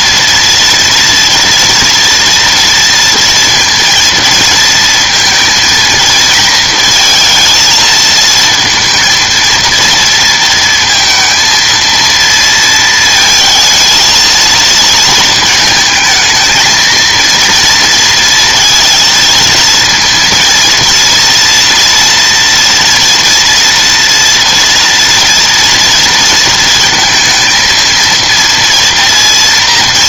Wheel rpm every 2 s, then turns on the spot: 230, 230, 230, 220, 230, 230, 230, 230, 230, 230, 230, 230, 230, 220, 230.
none